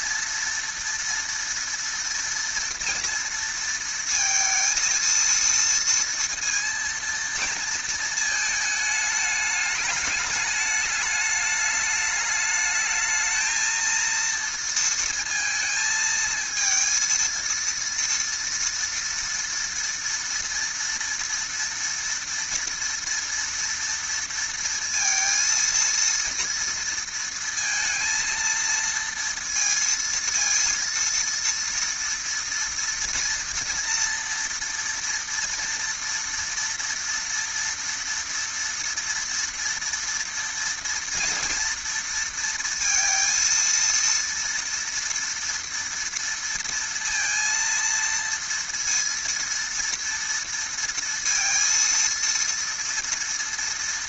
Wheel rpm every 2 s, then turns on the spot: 230, 230, 230, 230, 220, 210, 210, 230, 230, 230, 230, 230, 230, 230, 230, 230, 240, 230, 230, 230, 230, 230, 230, 230, 230, 230, 230.
none